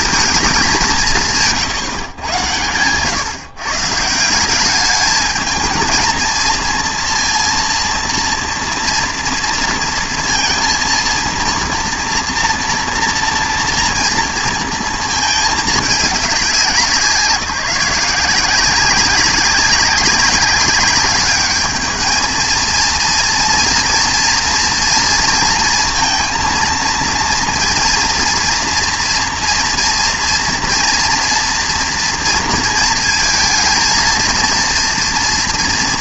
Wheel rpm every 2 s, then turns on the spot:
200, 110, 190, 230, 230, 230, 230, 230, 190, 180, 200, 230, 230, 230, 230, 230, 230, 230.
none